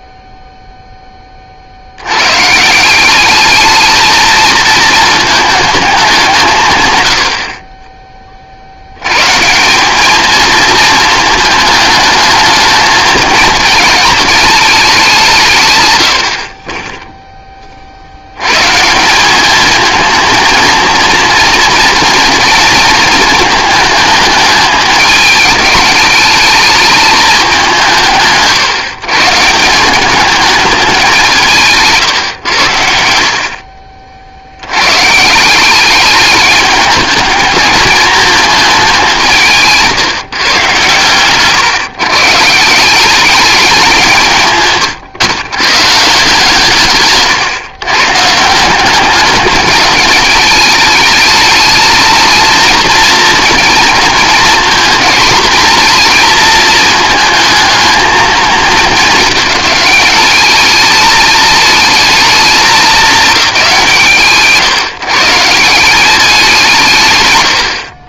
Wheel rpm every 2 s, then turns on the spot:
0, 140, 230, 170, 50, 220, 210, 210, 30, 120, 230, 230, 220, 210, 140, 210, 110, 70, 210, 220, 140, 160, 130, 150, 170, 210, 230, 220, 220, 210, 210, 210, 120, 180.
none